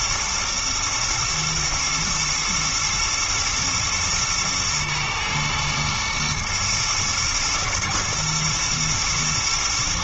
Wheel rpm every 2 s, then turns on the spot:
110, 110, 120, 120, 110.
none